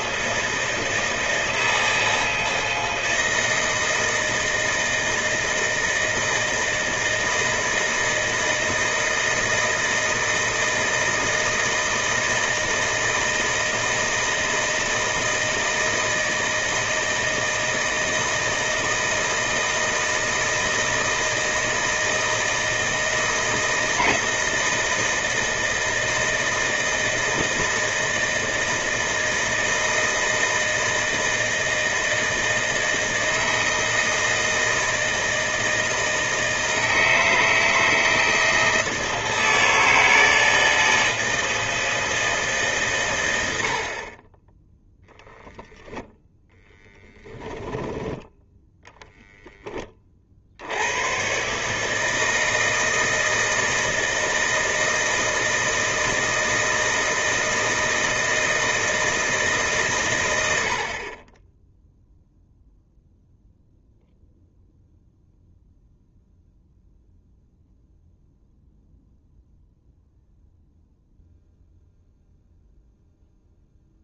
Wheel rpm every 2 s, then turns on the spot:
160, 160, 160, 160, 160, 160, 160, 160, 160, 160, 160, 160, 160, 160, 160, 160, 160, 160, 160, 160, 160, 150, 10, 0, 10, 60, 160, 160, 160, 160, 90, 0, 0, 0, 0, 0, 0.
none